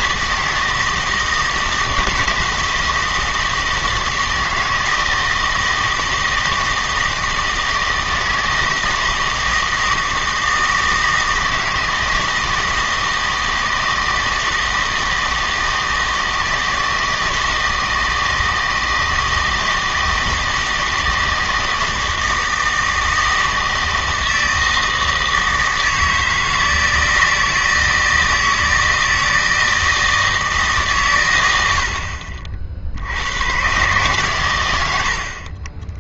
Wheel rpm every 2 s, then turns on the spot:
160, 160, 160, 160, 160, 160, 160, 160, 160, 160, 160, 160, 160, 160, 160, 150, 50, 100.
none